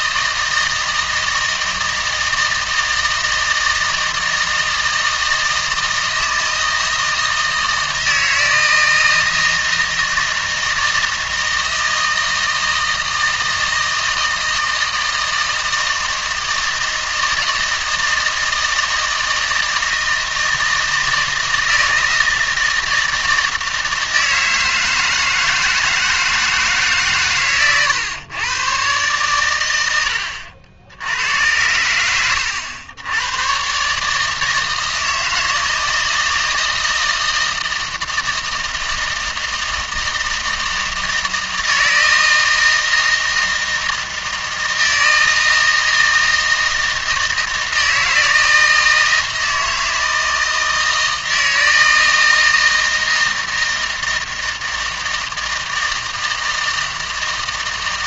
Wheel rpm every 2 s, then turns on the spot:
160, 160, 160, 160, 160, 160, 160, 160, 160, 160, 160, 160, 160, 160, 120, 80, 90, 160, 160, 160, 160, 160, 160, 160, 160, 160, 160, 160, 160.
none